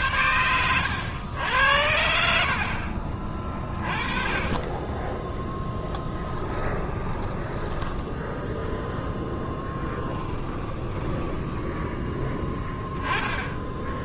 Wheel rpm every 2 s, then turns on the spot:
100, 50, 20, 20, 10, 20, 10.
6-8 10-12